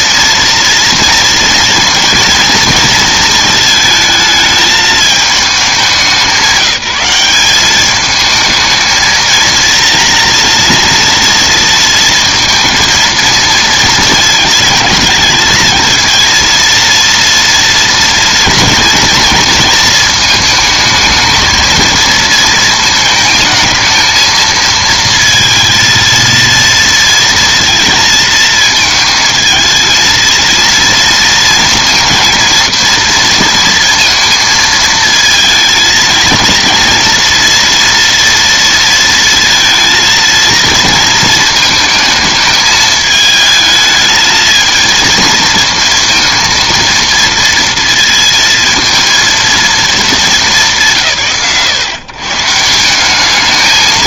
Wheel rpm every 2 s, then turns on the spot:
230, 230, 220, 190, 220, 230, 230, 220, 230, 230, 220, 230, 230, 230, 220, 230, 230, 230, 230, 230, 230, 220, 220, 230, 230, 130, 150.
none